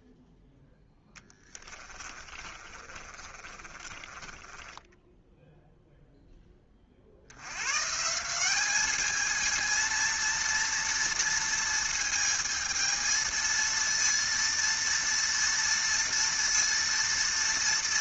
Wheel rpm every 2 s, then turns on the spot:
0, 30, 10, 20, 190, 230, 220, 230, 230.
2-6